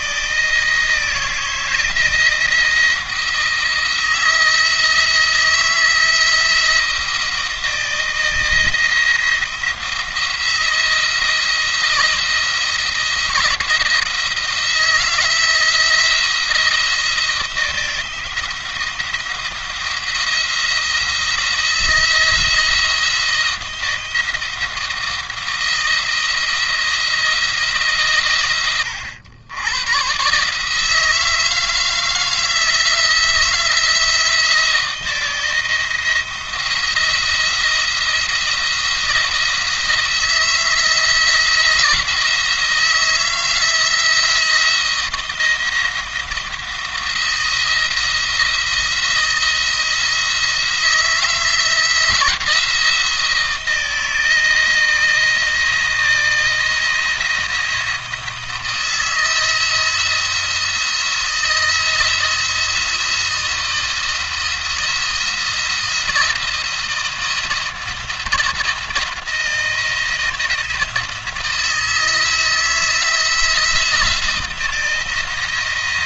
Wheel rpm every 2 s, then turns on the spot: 160, 170, 160, 160, 170, 170, 170, 160, 170, 170, 170, 170, 170, 170, 100, 150, 170, 160, 170, 170, 170, 170, 170, 170, 160, 160, 170, 160, 170, 160, 170, 170, 170, 170, 170, 160, 160, 160.
none